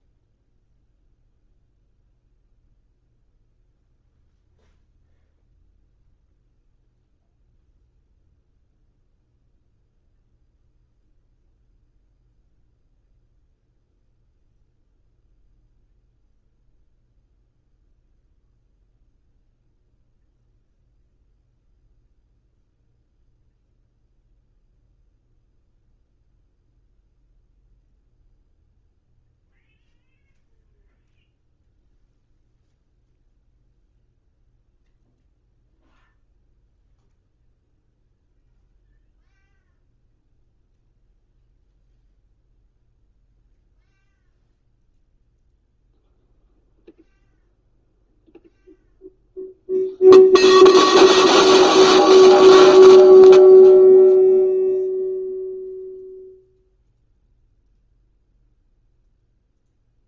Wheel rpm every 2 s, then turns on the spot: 0, 0, 0, 0, 0, 0, 0, 0, 0, 0, 0, 0, 0, 0, 0, 0, 0, 0, 0, 0, 0, 0, 0, 0, 0, 0, 0, 0, 0, 0.
none